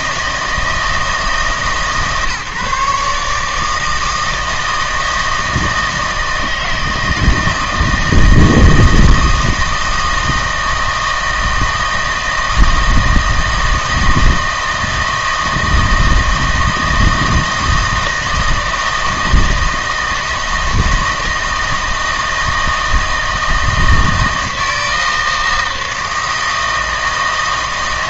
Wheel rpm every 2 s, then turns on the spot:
160, 140, 160, 160, 160, 160, 160, 160, 160, 160, 160, 160, 160, 160.
none